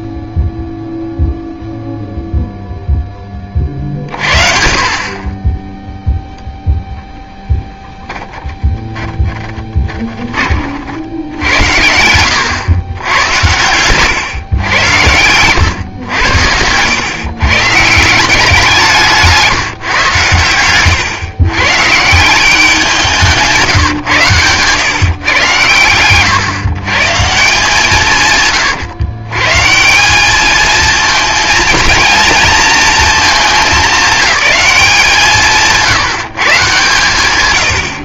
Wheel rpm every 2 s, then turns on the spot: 0, 10, 40, 0, 20, 80, 100, 110, 130, 160, 120, 170, 120, 150, 130, 230, 210, 170, 140.
8-12 14-16